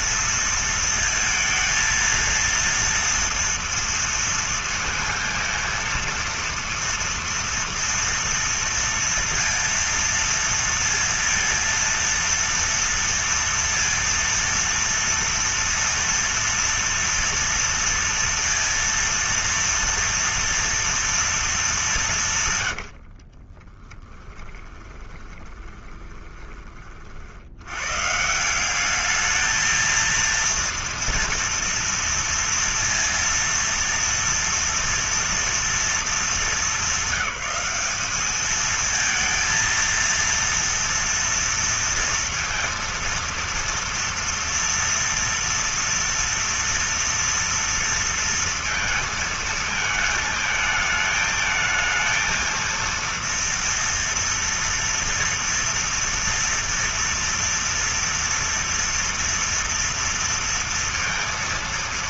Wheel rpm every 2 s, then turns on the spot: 230, 230, 230, 230, 230, 230, 230, 230, 230, 230, 230, 120, 10, 30, 170, 230, 230, 230, 200, 220, 230, 230, 230, 230, 230, 220, 230, 230, 230, 230, 230.
22-26